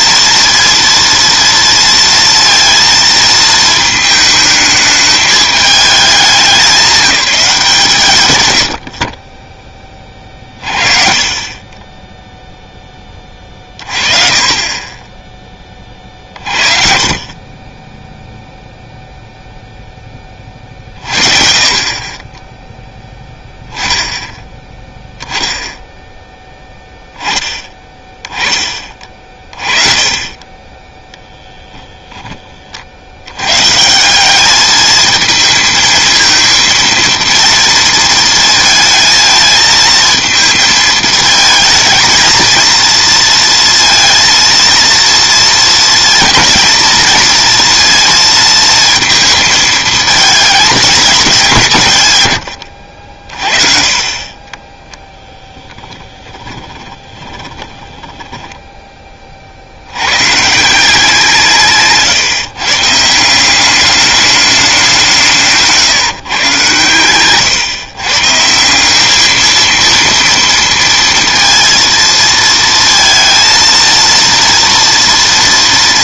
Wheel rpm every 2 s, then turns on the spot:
230, 230, 220, 200, 90, 30, 0, 30, 40, 0, 30, 10, 10, 10, 20, 20, 40, 210, 230, 230, 220, 230, 230, 230, 230, 220, 100, 20, 20, 10, 160, 150, 200, 120, 180, 230, 230, 230.
56-60